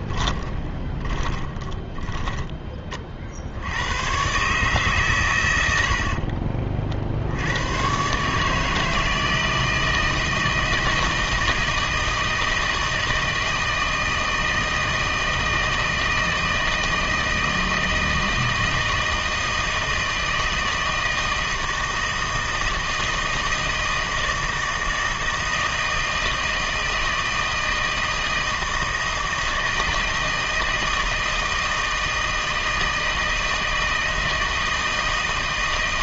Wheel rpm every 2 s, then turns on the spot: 20, 20, 140, 40, 150, 160, 160, 160, 160, 160, 160, 160, 160, 160, 160, 160, 160, 160.
0-4